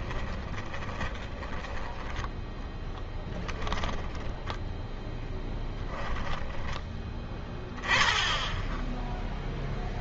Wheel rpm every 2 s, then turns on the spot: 20, 10, 0, 10, 10.
0-4